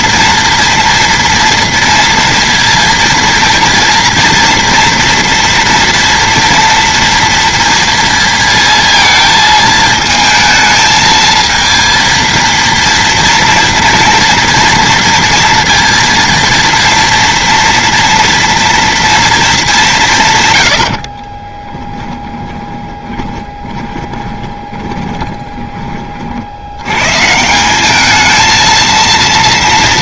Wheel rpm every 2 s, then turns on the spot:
230, 230, 230, 230, 230, 220, 230, 230, 230, 230, 120, 30, 20, 70, 220.
22-26